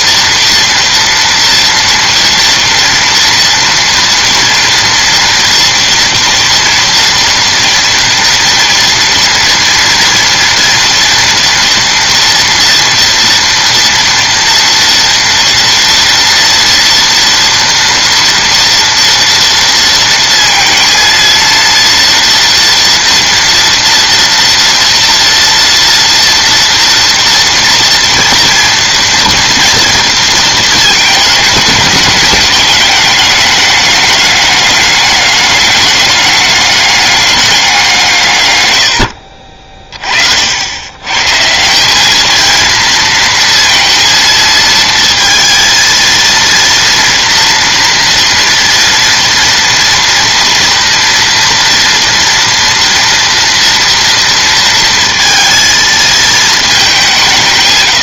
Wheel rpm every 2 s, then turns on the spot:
230, 230, 230, 230, 230, 230, 230, 230, 230, 230, 230, 230, 230, 230, 230, 230, 210, 210, 210, 110, 100, 230, 230, 230, 230, 230, 240, 230, 210.
none